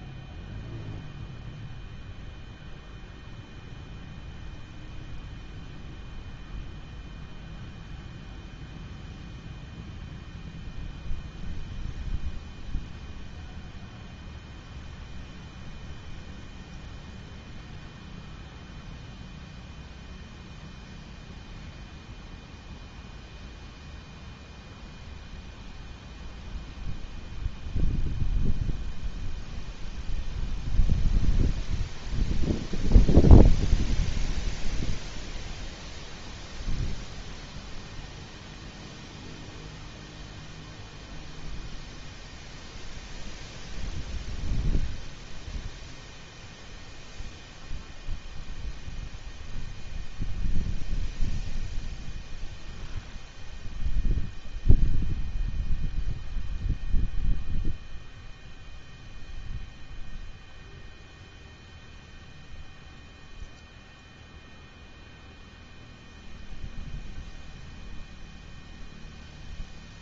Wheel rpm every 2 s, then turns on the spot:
0, 0, 0, 0, 0, 0, 0, 0, 0, 0, 0, 0, 0, 0, 0, 0, 0, 0, 0, 0, 0, 0, 0, 0, 0, 0, 0, 0, 0, 0, 0, 0, 0, 0, 0.
none